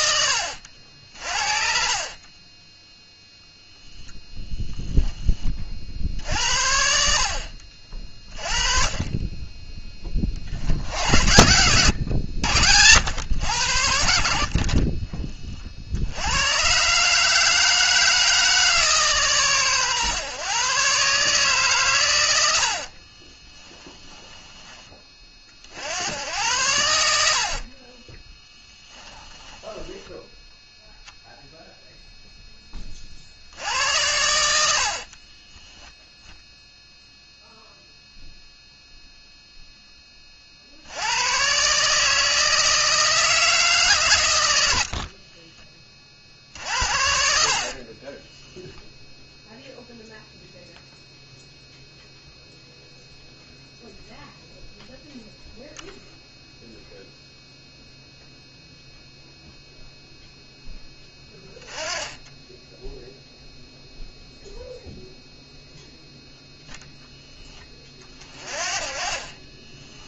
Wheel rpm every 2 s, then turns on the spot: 70, 10, 10, 70, 20, 70, 100, 50, 130, 150, 130, 60, 20, 90, 10, 0, 10, 70, 10, 0, 60, 160, 70, 90, 0, 0, 0, 0, 0, 0, 10, 10, 0, 0, 40.
14-16 22-24 28-30 34-36 68-70